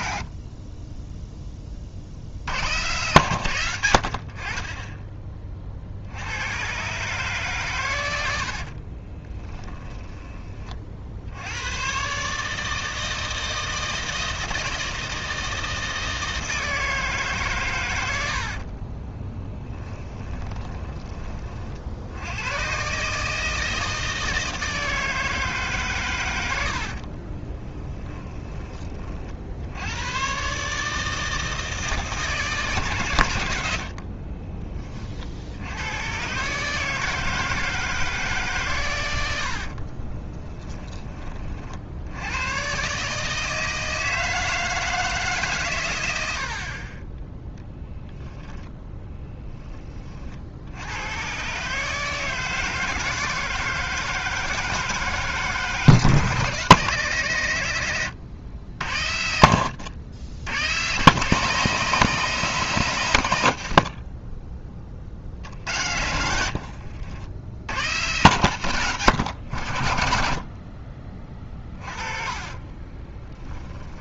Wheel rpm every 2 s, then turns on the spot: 30, 110, 20, 120, 50, 40, 160, 160, 160, 40, 20, 120, 160, 80, 20, 140, 150, 30, 150, 120, 10, 130, 160, 40, 10, 70, 160, 160, 140, 80, 110, 140, 30, 70, 130, 40, 30.
8-10 18-20 26-28 66-68 72-74